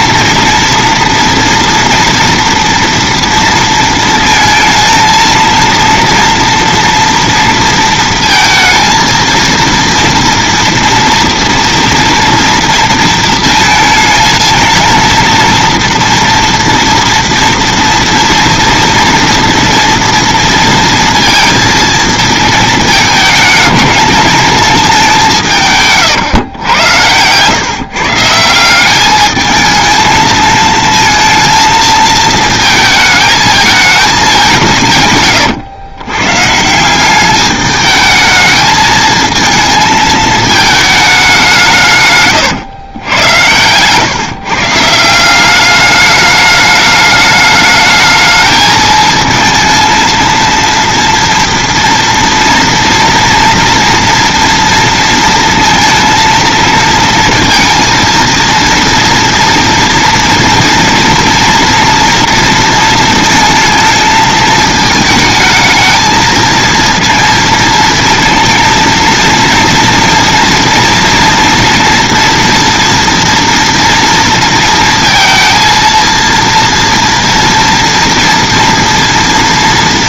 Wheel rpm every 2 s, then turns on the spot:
230, 240, 220, 230, 230, 240, 230, 230, 230, 230, 230, 220, 210, 110, 170, 220, 220, 180, 150, 220, 220, 110, 140, 210, 220, 230, 230, 230, 230, 230, 230, 230, 220, 230, 230, 230, 230, 230, 230, 230.
none